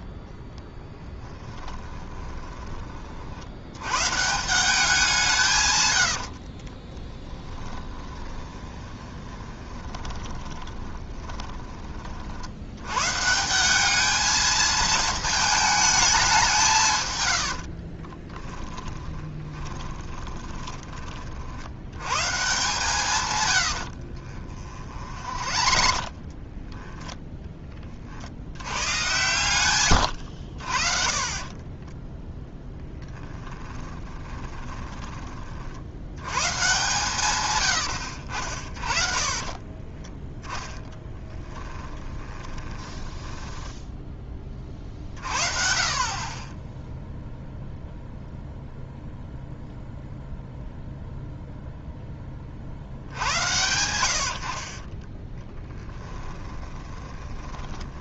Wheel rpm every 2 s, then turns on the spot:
0, 30, 180, 30, 20, 20, 110, 220, 140, 20, 20, 140, 40, 20, 110, 50, 10, 20, 140, 40, 10, 20, 40, 10, 0, 0, 70, 30, 20.
6-12 18-22 24-28 32-36 38-44 54-58